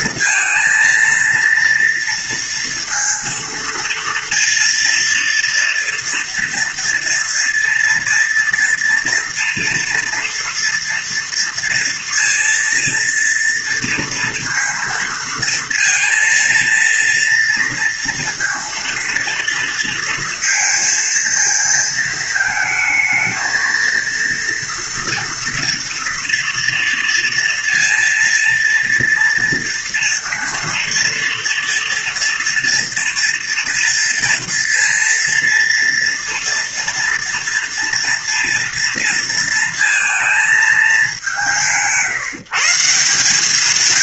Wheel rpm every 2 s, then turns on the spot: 230, 230, 230, 230, 230, 230, 230, 230, 230, 230, 230, 220, 230, 230, 230, 230, 230, 230, 230, 230, 210, 160.
none